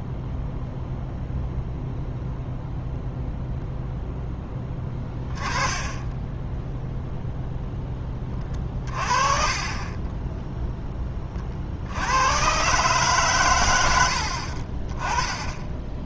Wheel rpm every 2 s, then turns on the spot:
0, 0, 20, 0, 30, 0, 130, 40.
8-10